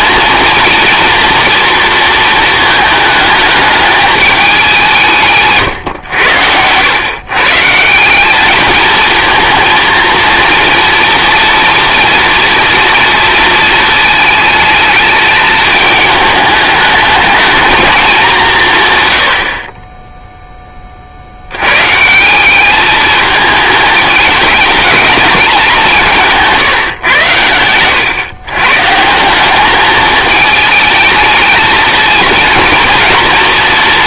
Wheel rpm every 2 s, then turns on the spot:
230, 220, 190, 110, 220, 230, 230, 220, 210, 160, 20, 200, 210, 160, 130, 210, 230.
none